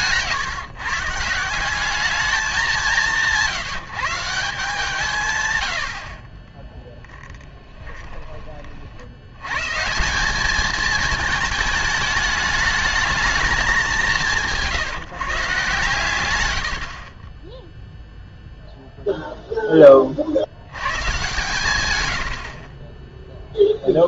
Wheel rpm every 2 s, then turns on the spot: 150, 200, 160, 10, 30, 210, 210, 160, 90, 0, 90, 50.
6-8